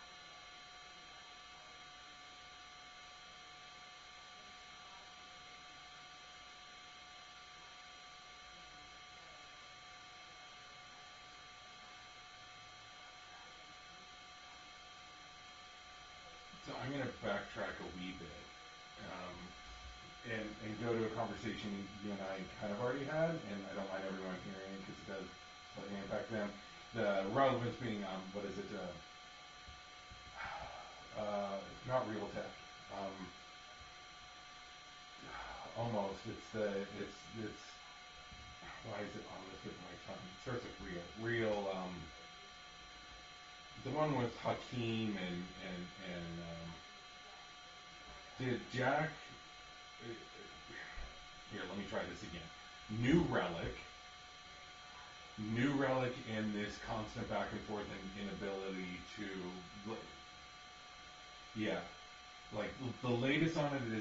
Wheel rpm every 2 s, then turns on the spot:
0, 0, 0, 0, 0, 0, 0, 0, 0, 0, 0, 0, 0, 0, 0, 0, 0, 0, 0, 0, 0, 0, 0, 0, 0, 0, 0, 0, 0, 0, 0, 0.
none